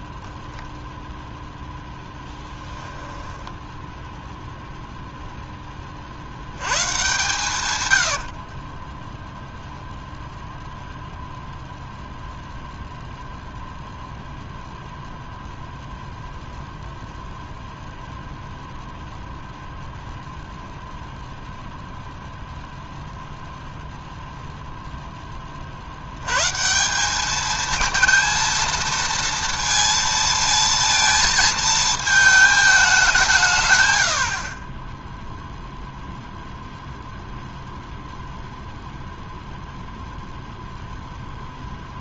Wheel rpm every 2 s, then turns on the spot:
10, 10, 0, 110, 10, 0, 0, 0, 0, 0, 0, 0, 0, 160, 230, 230, 210, 20, 0, 0, 0.
2-4 8-10